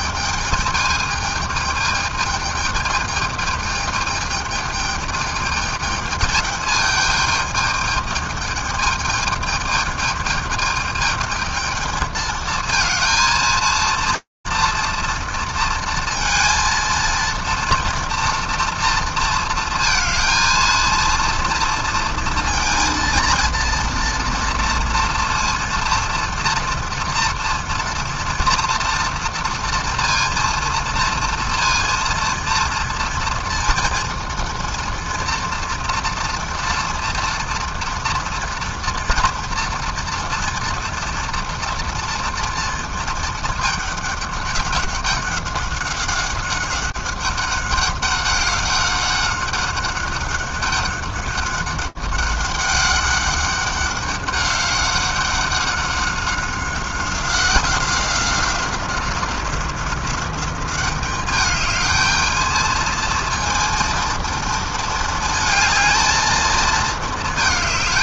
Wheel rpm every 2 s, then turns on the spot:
220, 220, 220, 220, 210, 210, 220, 230, 230, 230, 230, 230, 230, 230, 240, 230, 230, 230, 230, 230, 240, 230, 200, 190, 200, 200, 200, 200, 190, 190, 190, 220, 230, 220.
none